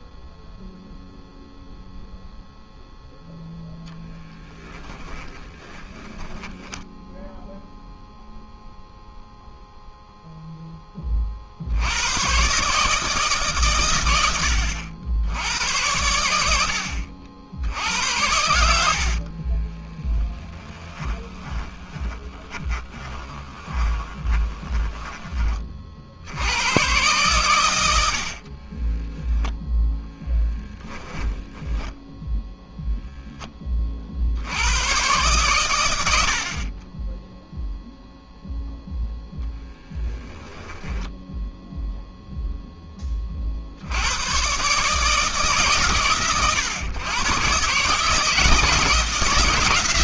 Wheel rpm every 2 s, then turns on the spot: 0, 0, 0, 20, 0, 0, 80, 100, 100, 80, 10, 30, 20, 100, 30, 10, 0, 100, 50, 0, 10, 0, 130, 110, 160.
6-8 20-26 28-32 40-42